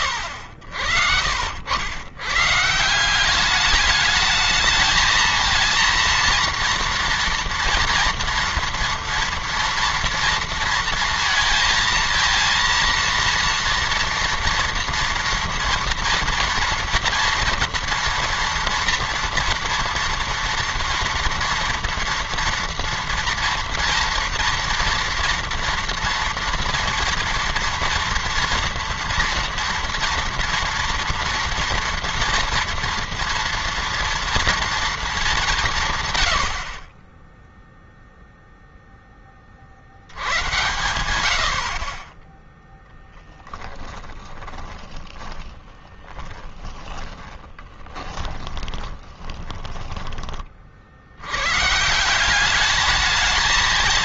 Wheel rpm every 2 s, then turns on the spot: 90, 150, 220, 230, 230, 230, 230, 240, 230, 230, 230, 240, 230, 230, 240, 240, 230, 230, 50, 0, 100, 0, 20, 10, 10, 50, 210.
44-50